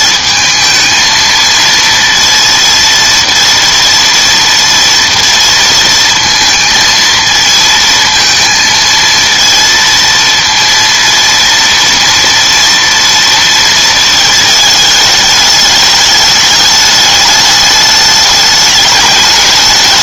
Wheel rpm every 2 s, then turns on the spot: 220, 230, 230, 230, 230, 230, 230, 220, 210, 210.
none